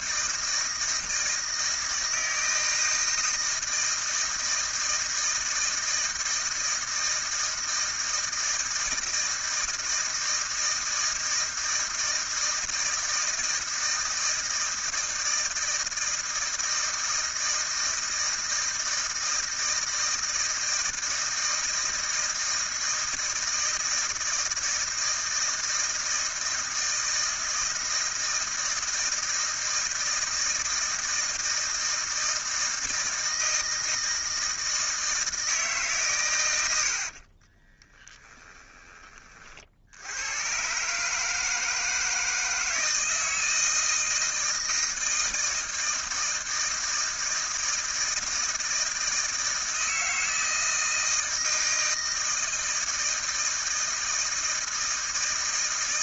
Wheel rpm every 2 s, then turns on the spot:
160, 160, 160, 160, 160, 160, 160, 160, 160, 160, 160, 160, 160, 160, 160, 160, 160, 160, 120, 20, 110, 160, 160, 160, 160, 160, 160, 160.
38-40